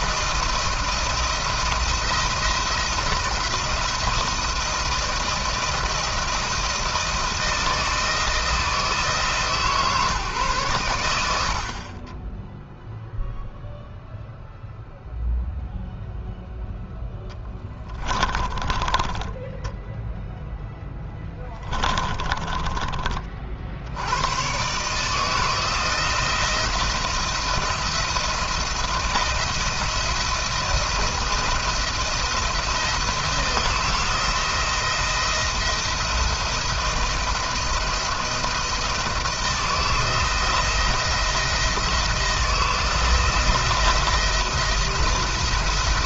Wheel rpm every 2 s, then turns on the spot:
170, 170, 170, 160, 160, 120, 0, 0, 0, 10, 10, 20, 120, 170, 170, 170, 170, 170, 170, 160, 170, 170, 170.
18-20 22-24